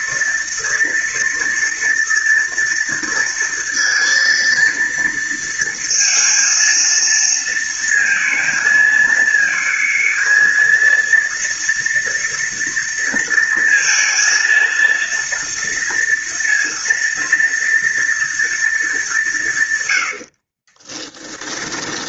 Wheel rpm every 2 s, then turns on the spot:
230, 230, 230, 230, 230, 230, 230, 230, 230, 220, 30.
20-22